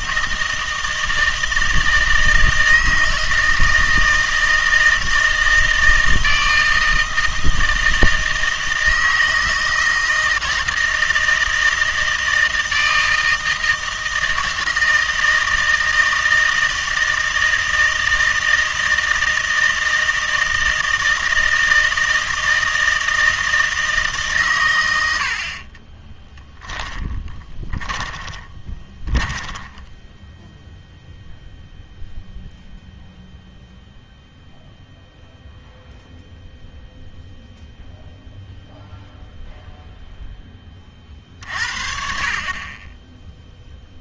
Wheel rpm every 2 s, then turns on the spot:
160, 160, 160, 160, 160, 160, 160, 160, 160, 160, 160, 160, 120, 10, 20, 0, 0, 0, 0, 0, 20, 30.
26-30